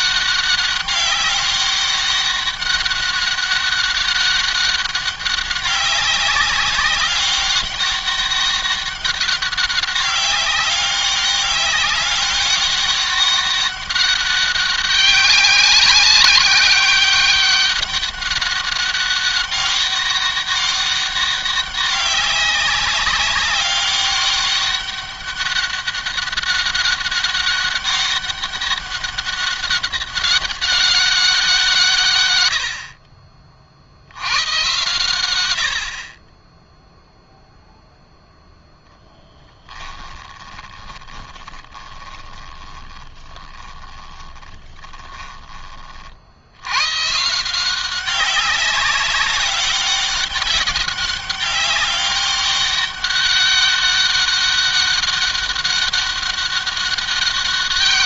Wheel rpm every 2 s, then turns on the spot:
200, 200, 200, 190, 200, 200, 200, 200, 190, 200, 200, 190, 200, 200, 200, 200, 70, 100, 10, 10, 20, 20, 20, 100, 200, 200, 200, 200, 200.
40-46